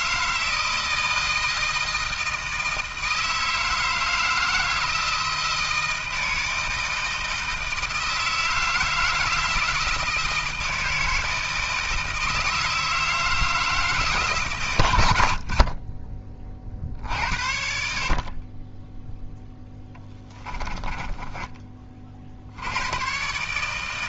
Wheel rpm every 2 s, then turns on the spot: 160, 160, 160, 160, 160, 160, 160, 130, 40, 30, 10, 80.
20-22